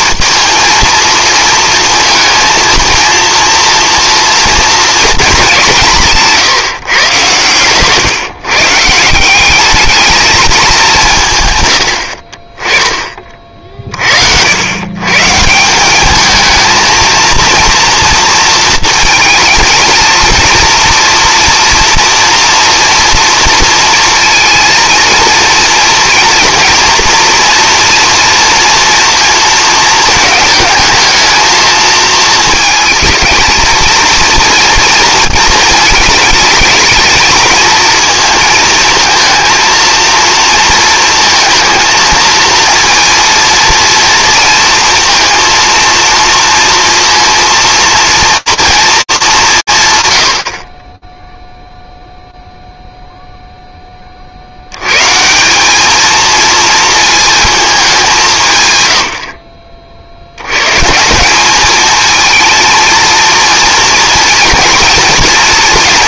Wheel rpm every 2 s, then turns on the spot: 230, 230, 230, 150, 150, 200, 30, 100, 220, 230, 230, 230, 230, 230, 230, 220, 220, 230, 220, 220, 230, 220, 230, 230, 230, 30, 0, 120, 230, 80, 160, 230, 230.
none